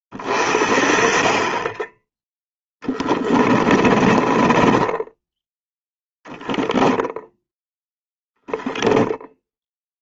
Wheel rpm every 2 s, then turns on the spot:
30, 10, 10, 0, 0.
2-6